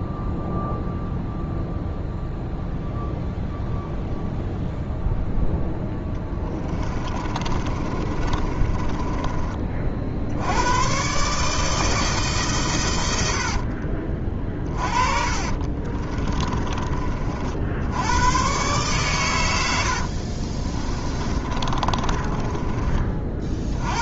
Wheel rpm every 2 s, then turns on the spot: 0, 0, 0, 20, 20, 100, 130, 40, 30, 120, 30, 30.
6-10 14-18 20-24